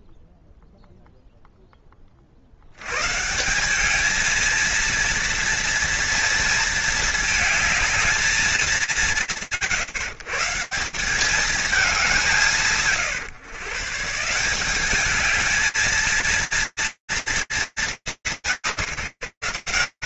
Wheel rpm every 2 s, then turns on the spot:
0, 0, 180, 230, 220, 140, 190, 140, 230, 190.
none